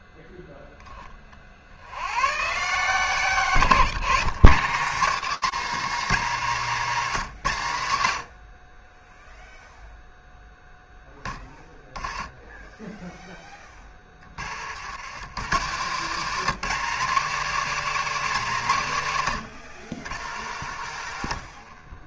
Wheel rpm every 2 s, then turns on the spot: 10, 140, 190, 220, 30, 10, 10, 140, 240, 160, 70.
none